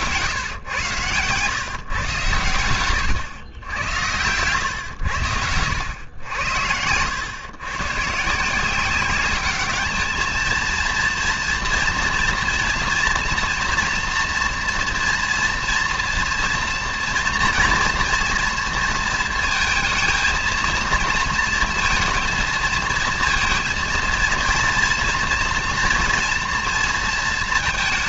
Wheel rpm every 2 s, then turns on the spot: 110, 120, 100, 100, 200, 230, 230, 230, 230, 230, 230, 230, 230, 230.
4-6